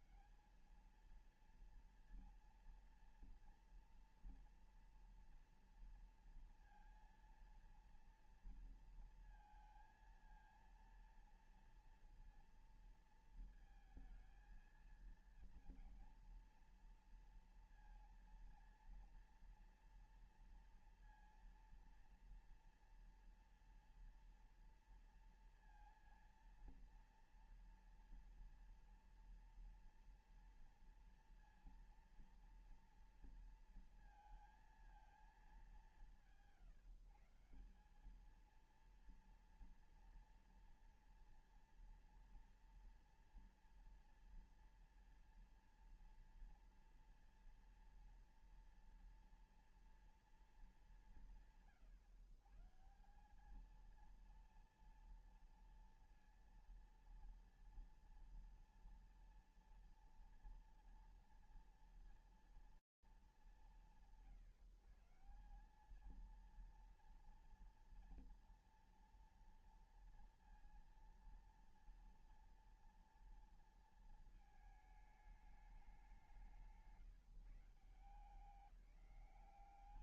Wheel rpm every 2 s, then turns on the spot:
190, 230, 230, 230, 230, 230, 230, 220, 230, 230, 240, 230, 240, 230, 230, 230, 230, 230, 160, 200, 230, 230, 230, 230, 240, 230, 130, 230, 230, 240, 230, 230, 160, 230, 240, 230, 230, 220, 180, 180.
none